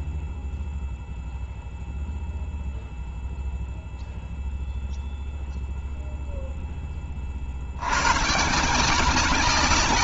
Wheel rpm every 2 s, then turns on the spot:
0, 0, 0, 70, 190.
none